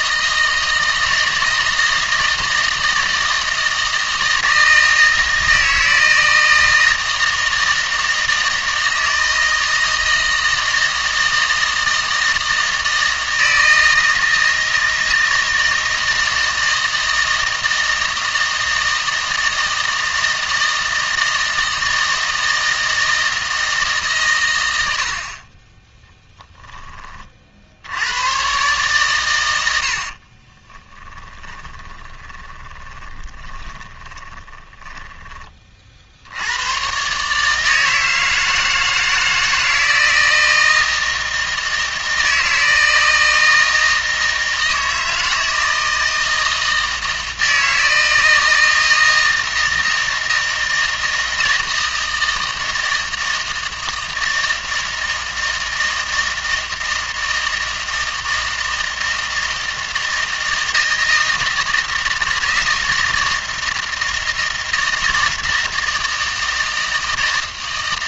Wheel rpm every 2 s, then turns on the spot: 160, 160, 160, 160, 160, 160, 160, 160, 160, 160, 160, 160, 80, 10, 130, 10, 20, 20, 100, 160, 160, 160, 160, 160, 160, 160, 160, 160, 160, 160, 160, 160, 160, 160.
30-36